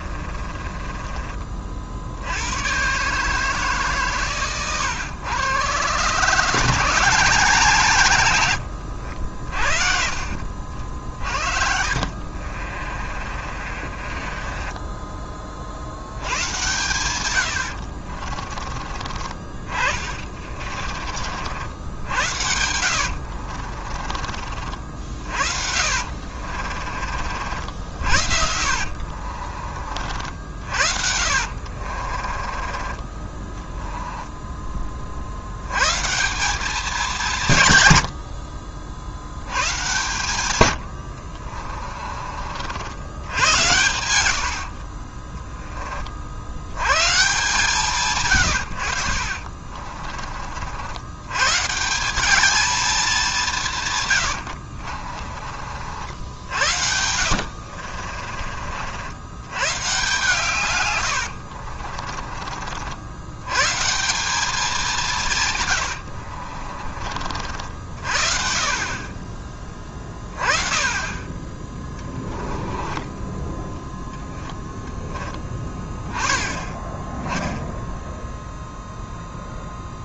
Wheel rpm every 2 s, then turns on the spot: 20, 130, 120, 160, 90, 60, 50, 20, 110, 30, 40, 80, 60, 40, 60, 50, 20, 30, 200, 70, 80, 80, 50, 110, 80, 80, 220, 60, 70, 60, 120, 70, 180, 50, 40, 30, 20, 10, 20, 0.
0-2 8-14 20-24 26-34 44-46 54-58 66-68 72-74